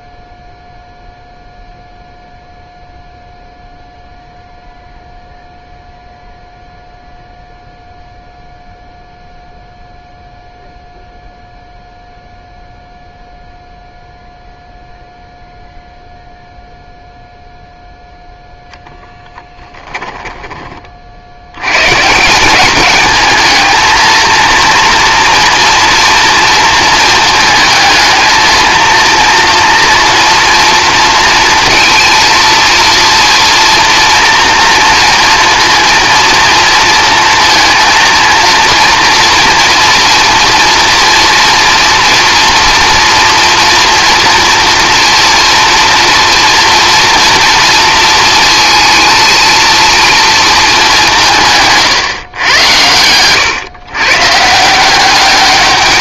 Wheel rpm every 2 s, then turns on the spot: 0, 0, 0, 0, 0, 0, 0, 0, 0, 0, 30, 200, 230, 230, 230, 230, 230, 230, 230, 230, 230, 230, 240, 240, 230, 220, 110, 170.
none